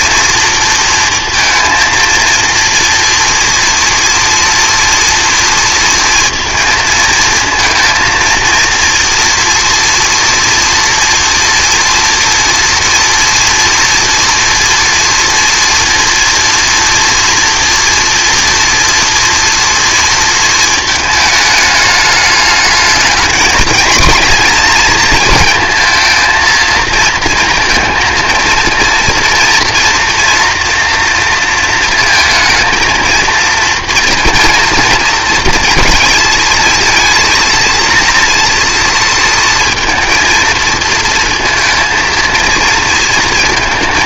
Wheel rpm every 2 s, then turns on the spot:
230, 230, 230, 220, 230, 230, 240, 230, 240, 230, 220, 210, 230, 230, 230, 230, 220, 230, 230, 230, 230, 230.
none